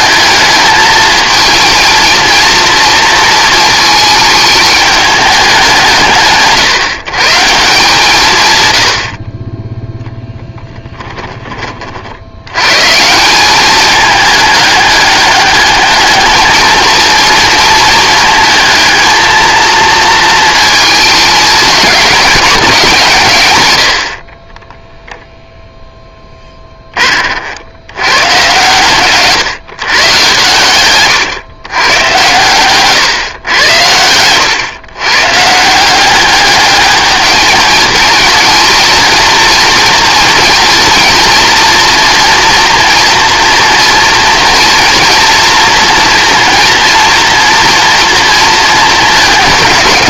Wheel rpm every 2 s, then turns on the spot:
220, 230, 210, 150, 100, 10, 120, 210, 220, 230, 220, 180, 10, 20, 130, 120, 130, 120, 210, 230, 230, 240, 230, 230, 220.
10-12 24-26 30-32